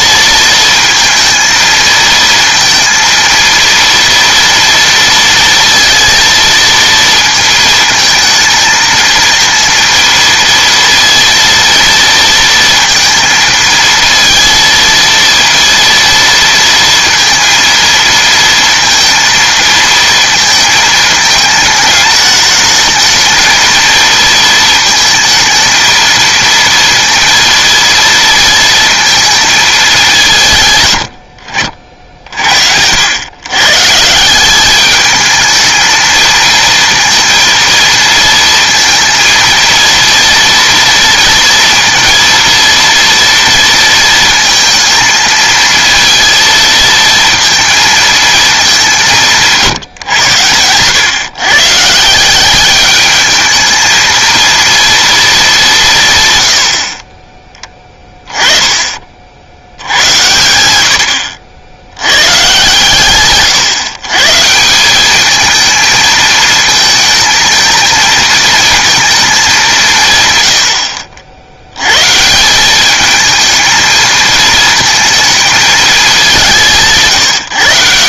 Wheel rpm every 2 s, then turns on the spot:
230, 230, 230, 230, 220, 230, 230, 230, 230, 230, 220, 220, 220, 230, 230, 120, 70, 210, 230, 230, 230, 230, 220, 230, 200, 110, 210, 230, 60, 30, 80, 140, 180, 220, 220, 70, 200, 220, 170.
none